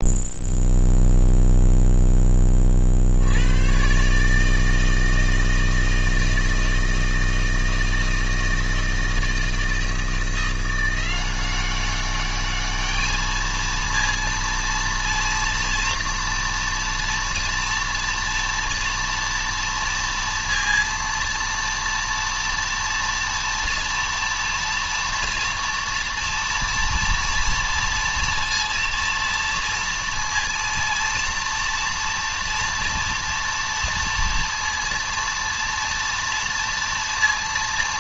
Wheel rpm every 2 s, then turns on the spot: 0, 30, 160, 160, 160, 170, 210, 230, 230, 230, 230, 230, 230, 230, 230, 230, 230, 230, 230.
none